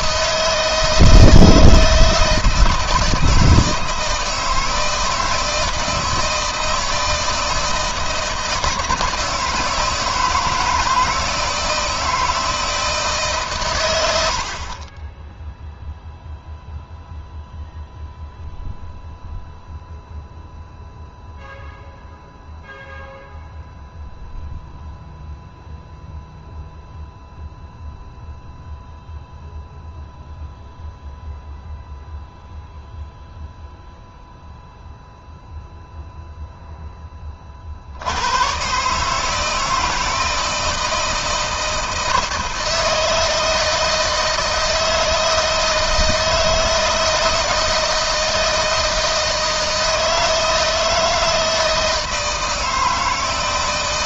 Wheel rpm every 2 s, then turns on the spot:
160, 160, 160, 160, 160, 160, 160, 30, 0, 0, 0, 0, 0, 0, 0, 0, 0, 0, 10, 150, 160, 160, 160, 160, 160, 160, 160.
none